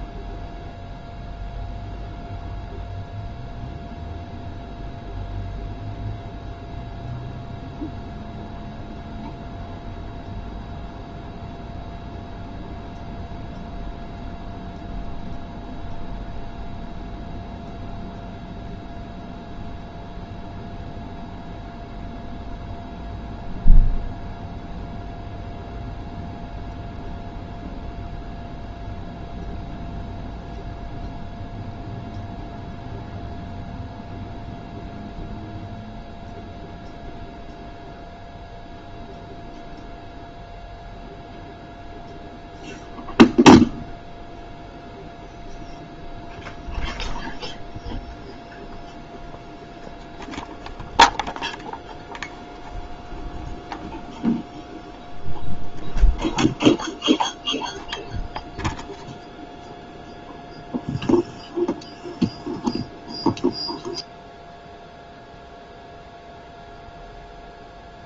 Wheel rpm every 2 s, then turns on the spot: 0, 0, 0, 0, 0, 0, 0, 0, 0, 0, 0, 0, 0, 0, 0, 0, 0, 0, 0, 0, 0, 0, 0, 0, 0, 0, 0, 0, 0, 0, 0, 0, 0, 0.
none